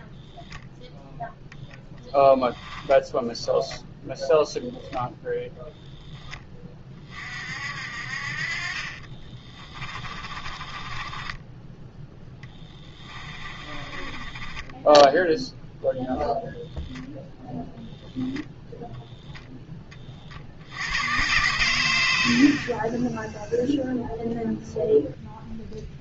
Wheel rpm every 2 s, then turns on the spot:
0, 10, 0, 20, 40, 30, 20, 10, 0, 0, 90, 20, 0.
8-16